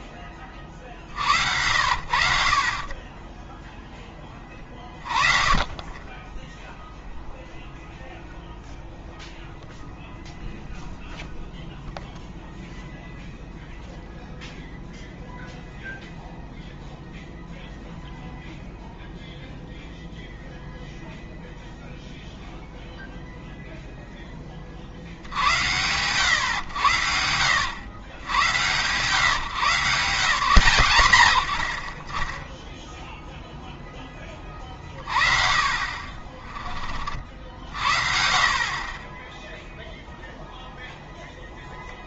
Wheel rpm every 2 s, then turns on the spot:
30, 50, 20, 0, 0, 0, 0, 0, 0, 0, 0, 0, 30, 110, 110, 140, 10, 30, 30, 40, 0.
none